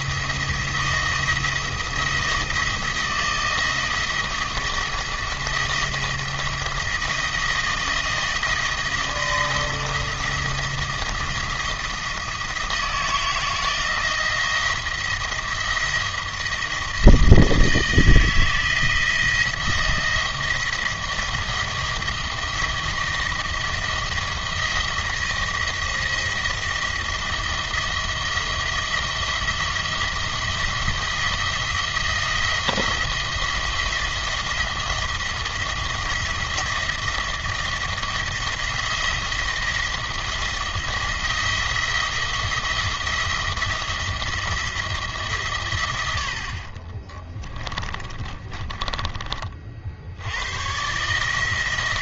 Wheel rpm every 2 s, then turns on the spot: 170, 170, 160, 170, 160, 170, 160, 170, 170, 160, 170, 170, 170, 170, 170, 170, 170, 170, 170, 170, 170, 170, 160, 60, 30, 120.
48-50